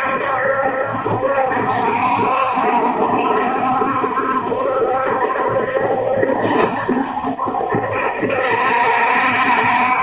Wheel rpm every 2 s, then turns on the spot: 70, 70, 70, 60, 70.
none